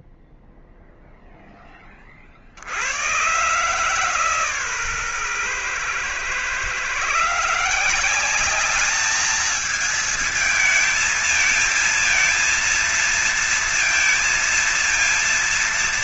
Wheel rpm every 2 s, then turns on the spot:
0, 90, 140, 140, 200, 220, 230, 230.
none